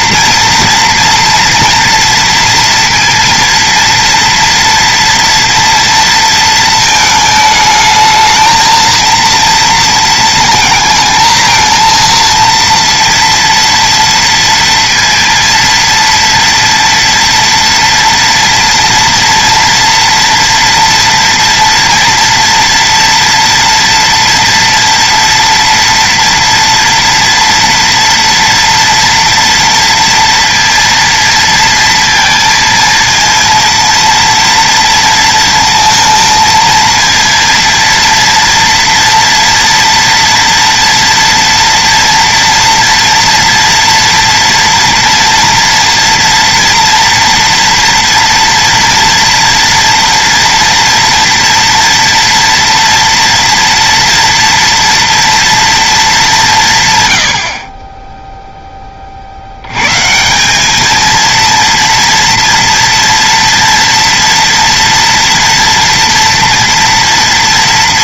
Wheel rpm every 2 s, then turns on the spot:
230, 230, 230, 230, 220, 230, 230, 230, 230, 240, 240, 230, 230, 230, 230, 230, 230, 230, 230, 230, 230, 230, 230, 230, 230, 230, 240, 230, 210, 10, 160, 230, 230, 230.
none